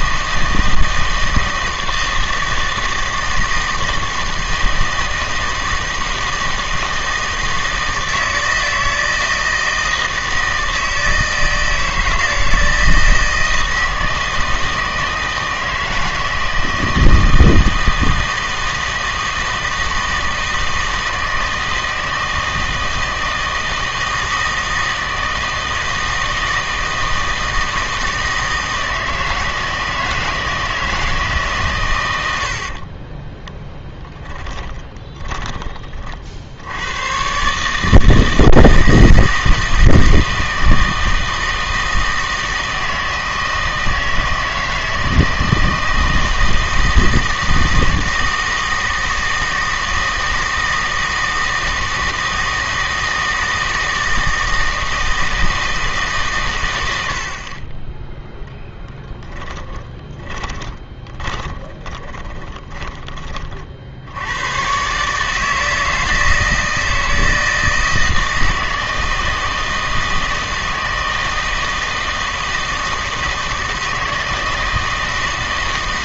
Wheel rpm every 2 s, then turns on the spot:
160, 160, 160, 160, 160, 160, 160, 160, 160, 160, 160, 160, 160, 160, 160, 160, 50, 10, 90, 160, 160, 160, 160, 160, 160, 160, 160, 160, 100, 0, 20, 20, 120, 160, 160, 160, 160, 160.
32-36 60-64